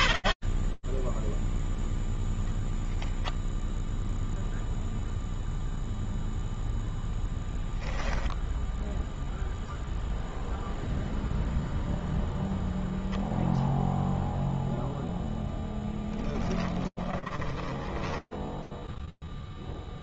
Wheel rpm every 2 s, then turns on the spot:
20, 0, 0, 0, 0, 0, 0, 0, 10, 0.
0-2 16-18